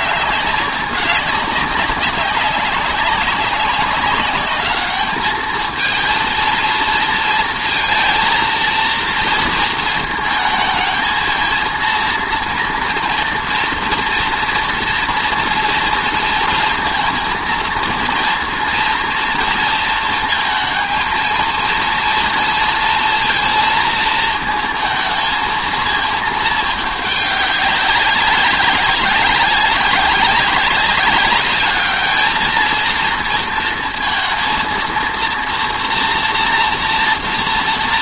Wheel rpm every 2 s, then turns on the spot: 200, 190, 210, 220, 230, 220, 230, 240, 230, 230, 230, 230, 220, 210, 200, 200, 220, 230, 230.
none